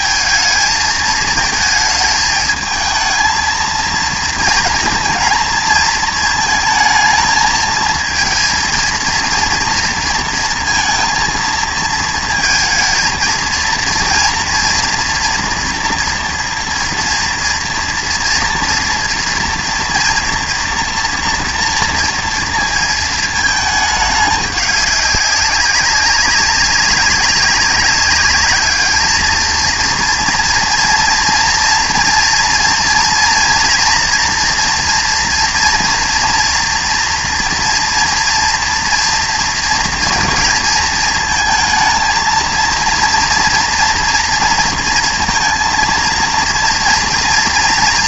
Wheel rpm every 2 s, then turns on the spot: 220, 220, 230, 220, 230, 230, 230, 230, 230, 240, 230, 230, 200, 200, 210, 230, 230, 230, 230, 230, 220, 230, 230, 230.
none